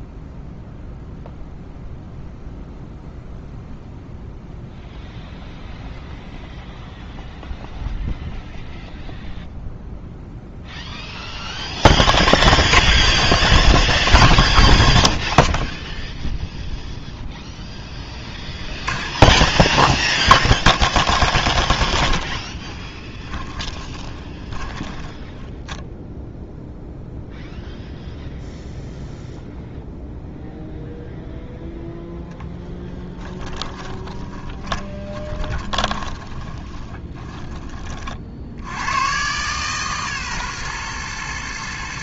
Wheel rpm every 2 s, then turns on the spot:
0, 0, 0, 0, 0, 0, 0, 0, 0, 30, 30, 10, 20, 0, 0, 0, 10, 20, 20, 90, 120.
18-26 34-38